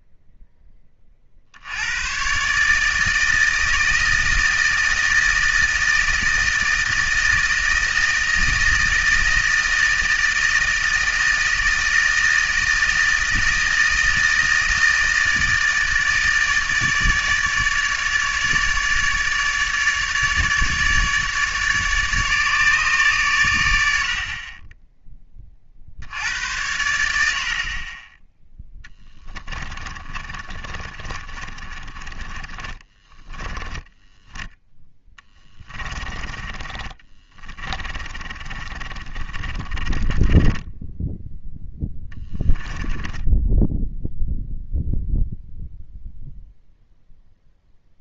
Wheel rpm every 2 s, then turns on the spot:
10, 150, 160, 160, 160, 160, 160, 160, 160, 150, 150, 150, 20, 90, 10, 30, 20, 10, 30, 30, 10, 10, 0, 0.
28-34 36-44